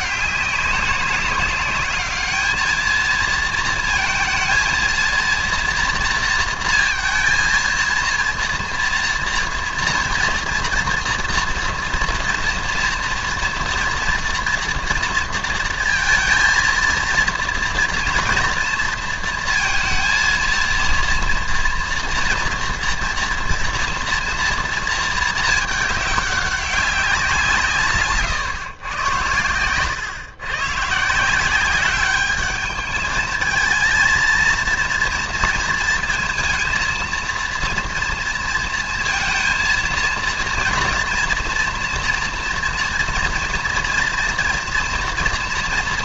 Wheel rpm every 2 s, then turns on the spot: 190, 220, 230, 230, 230, 230, 230, 230, 230, 230, 230, 230, 230, 200, 120, 130, 210, 230, 230, 230, 230, 240, 230.
none